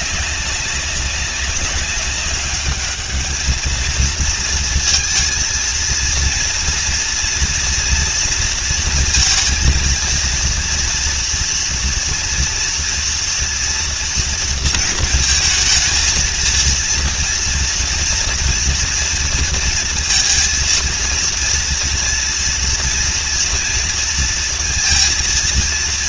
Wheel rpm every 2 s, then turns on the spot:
190, 200, 230, 230, 230, 230, 230, 230, 230, 240, 230, 230, 230.
none